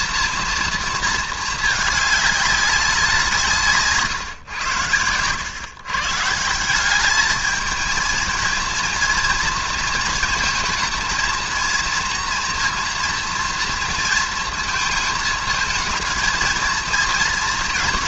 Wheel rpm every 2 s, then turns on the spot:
230, 200, 120, 160, 220, 230, 230, 230, 220.
none